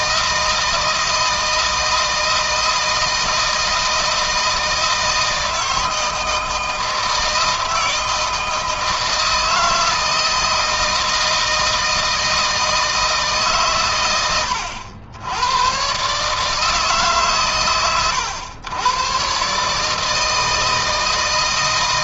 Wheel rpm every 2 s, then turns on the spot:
160, 160, 160, 160, 160, 160, 150, 100, 140, 130, 160.
none